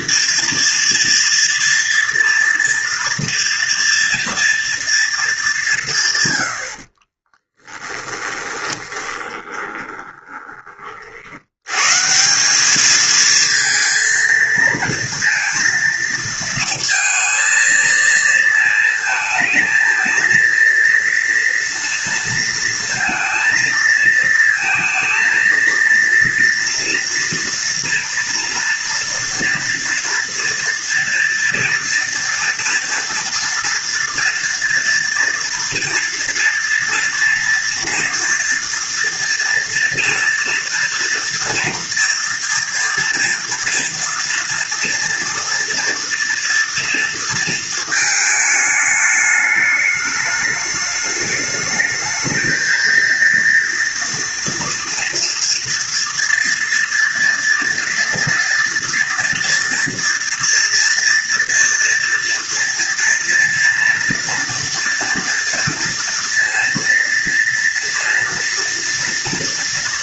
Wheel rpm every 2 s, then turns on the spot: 230, 240, 230, 100, 20, 20, 180, 230, 220, 220, 230, 230, 230, 230, 230, 230, 230, 230, 230, 230, 230, 240, 230, 230, 220, 210, 220, 230, 230, 230, 230, 230, 230, 230, 230.
8-12